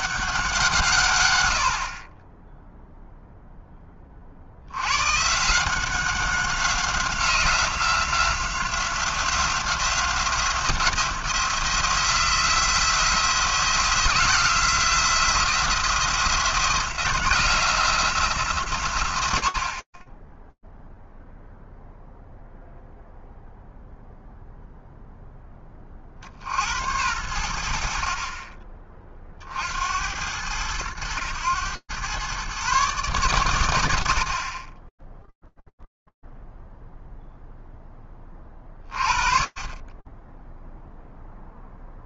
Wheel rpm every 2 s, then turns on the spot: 150, 0, 110, 180, 180, 170, 170, 170, 180, 110, 0, 0, 0, 80, 20, 100, 130, 10, 0, 30, 0.
none